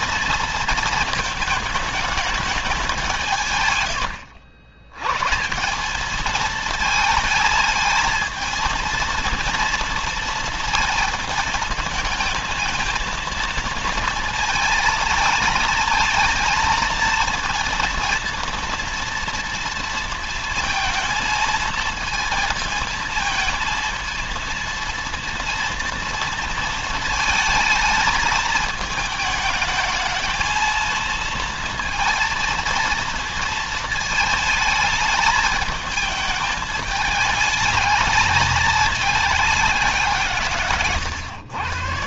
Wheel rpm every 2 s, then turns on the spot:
230, 190, 100, 220, 230, 230, 230, 230, 230, 230, 230, 220, 230, 230, 220, 230, 230, 220, 220, 210, 120.
none